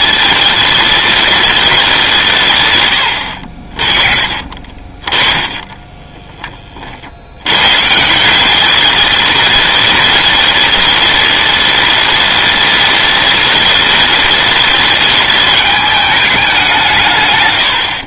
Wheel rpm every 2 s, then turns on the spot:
210, 120, 30, 40, 210, 210, 210, 210, 170.
4-6